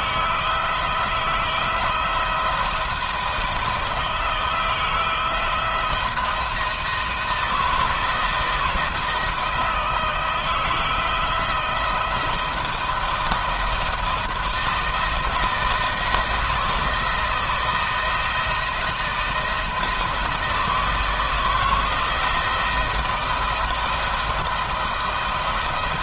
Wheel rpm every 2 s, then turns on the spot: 160, 160, 160, 160, 160, 160, 160, 160, 160, 160, 160, 170, 170.
none